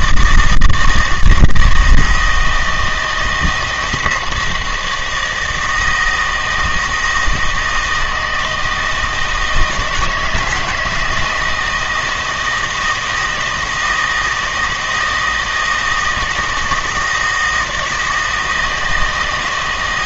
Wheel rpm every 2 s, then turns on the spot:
160, 160, 160, 160, 160, 170, 160, 160, 160, 160.
none